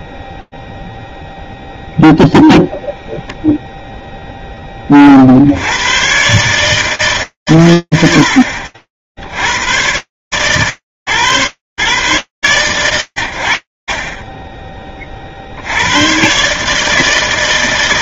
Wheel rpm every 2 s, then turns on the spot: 0, 10, 130, 70, 120, 130, 60, 100, 120.
none